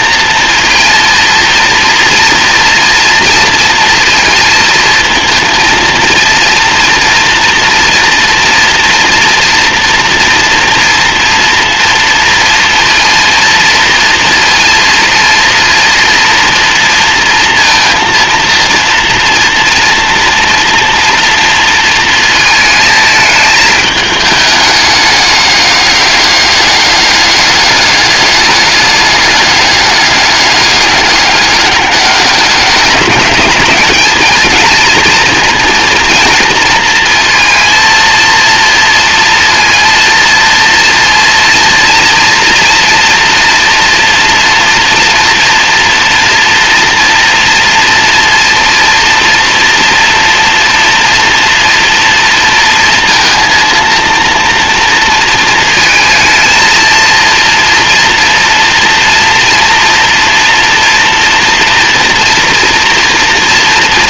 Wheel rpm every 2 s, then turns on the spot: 230, 230, 230, 240, 230, 230, 230, 230, 230, 230, 230, 220, 210, 210, 200, 200, 200, 220, 230, 230, 230, 230, 230, 230, 240, 230, 230, 230, 230, 230, 230, 230.
none